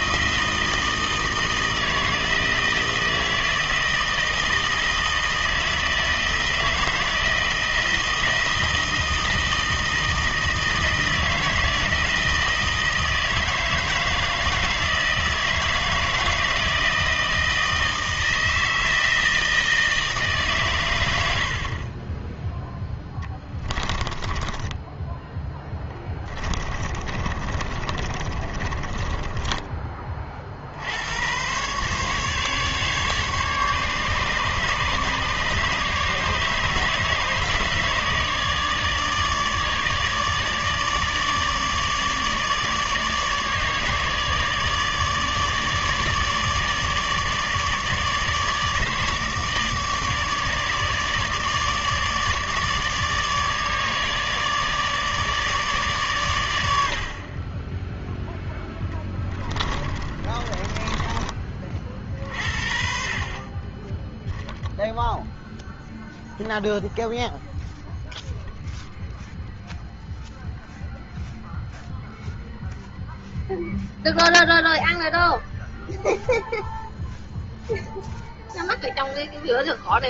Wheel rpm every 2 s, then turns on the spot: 160, 160, 160, 160, 160, 160, 160, 160, 160, 160, 130, 10, 10, 20, 30, 60, 150, 150, 150, 150, 150, 150, 150, 150, 150, 150, 150, 150, 80, 10, 20, 50, 0, 0, 0, 0, 0, 0, 0, 0.
24-30 58-62